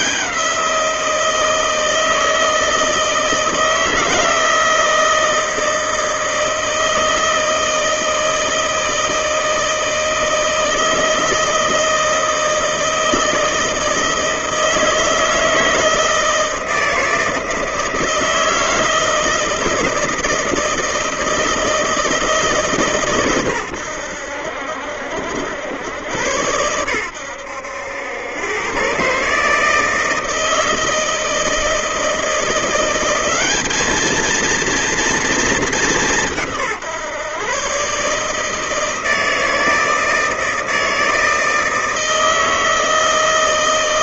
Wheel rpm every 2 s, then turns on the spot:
170, 160, 160, 160, 160, 160, 160, 160, 160, 160, 160, 140, 70, 100, 130, 160, 180, 230, 150, 160, 160, 160.
none